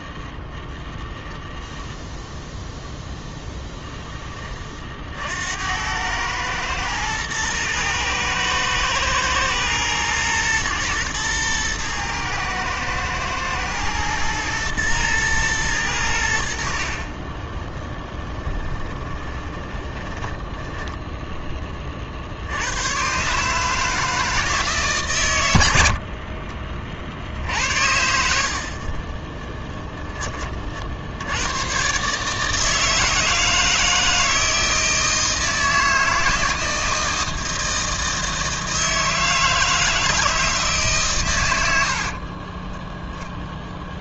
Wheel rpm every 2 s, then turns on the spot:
0, 0, 30, 110, 110, 120, 110, 120, 60, 10, 10, 90, 150, 40, 50, 50, 160, 160, 160, 160, 150, 20.
18-22 42-44